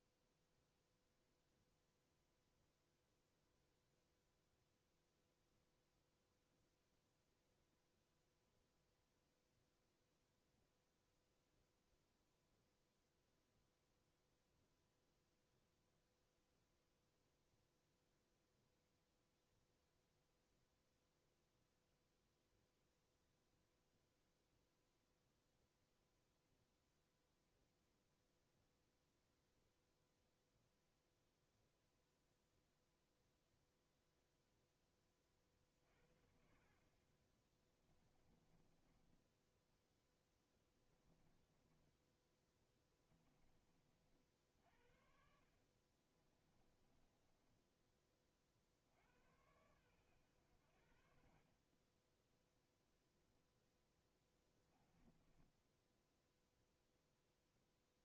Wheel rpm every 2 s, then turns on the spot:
0, 0, 0, 0, 0, 0, 0, 0, 0, 0, 0, 0, 0, 0, 0, 0, 0, 0, 40, 20, 10, 20, 60, 20, 50, 90, 0, 20, 0.
36-44 46-48 54-56